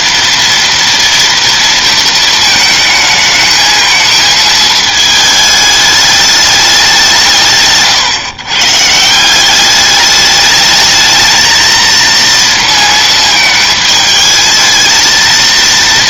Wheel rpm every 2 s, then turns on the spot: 230, 220, 220, 200, 140, 210, 230, 220.
none